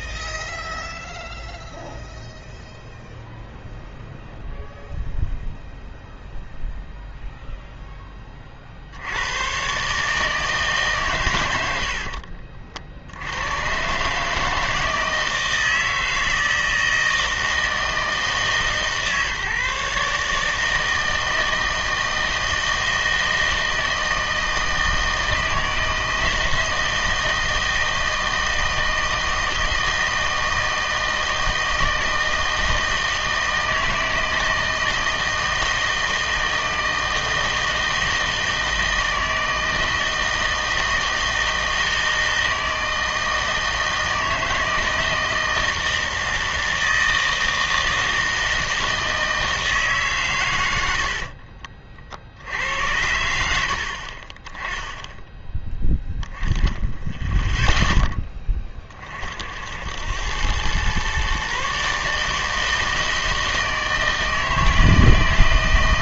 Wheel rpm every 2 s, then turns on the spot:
0, 0, 0, 0, 60, 140, 50, 160, 160, 150, 150, 160, 160, 160, 160, 160, 160, 160, 160, 160, 160, 160, 160, 160, 160, 100, 70, 10, 10, 20, 110, 160, 160.
none